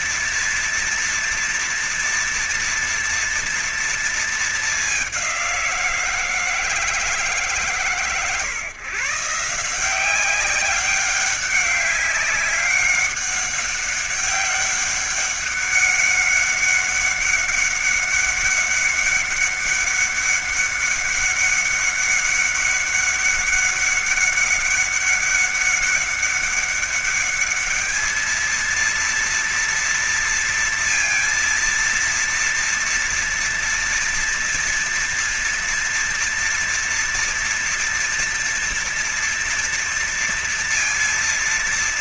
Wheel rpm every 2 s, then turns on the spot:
230, 230, 230, 170, 130, 180, 200, 200, 200, 200, 200, 200, 200, 200, 220, 230, 230, 230, 230, 230, 230.
none